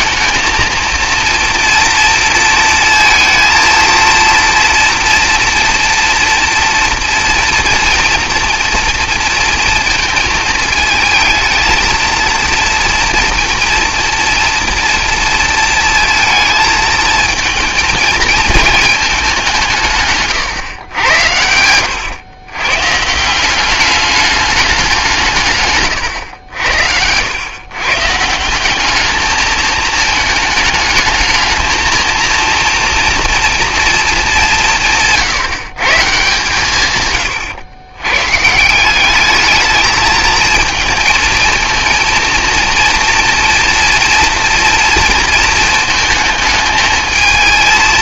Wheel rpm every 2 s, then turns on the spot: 230, 230, 230, 230, 230, 220, 230, 230, 220, 220, 120, 140, 190, 80, 190, 210, 230, 170, 140, 180, 220, 230, 230, 220.
none